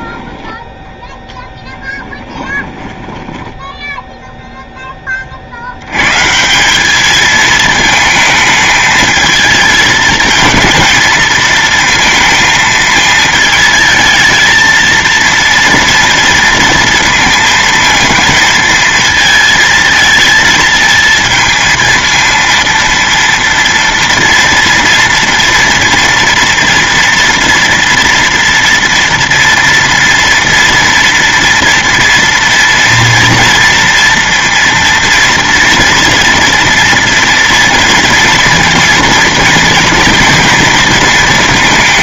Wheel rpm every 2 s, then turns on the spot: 10, 20, 0, 180, 220, 220, 220, 230, 230, 230, 220, 230, 230, 230, 230, 230, 230, 230, 230, 230, 230.
2-4